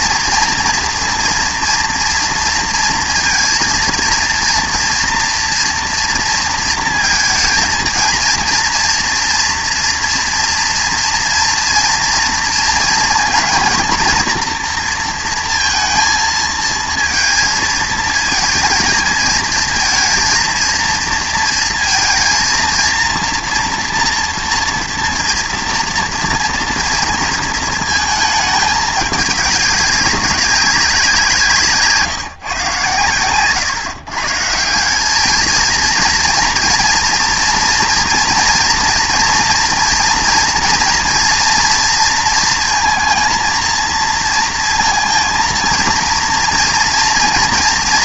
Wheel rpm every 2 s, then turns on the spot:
230, 230, 230, 230, 230, 230, 230, 230, 220, 220, 230, 230, 240, 230, 210, 190, 130, 160, 240, 230, 230, 230, 230, 230.
none